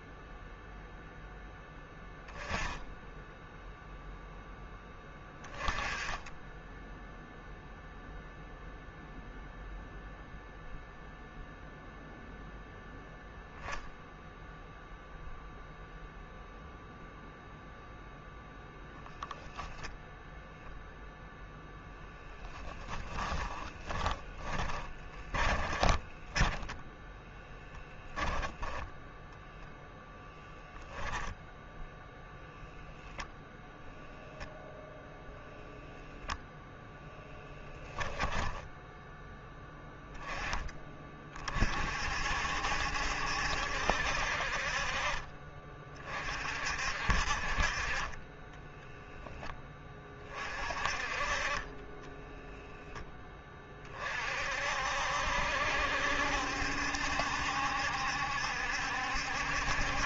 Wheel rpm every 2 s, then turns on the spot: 0, 10, 10, 10, 0, 0, 0, 0, 0, 0, 0, 10, 20, 10, 0, 10, 0, 0, 0, 10, 30, 60, 50, 50, 10, 40, 0, 50, 70, 70.
22-28 48-50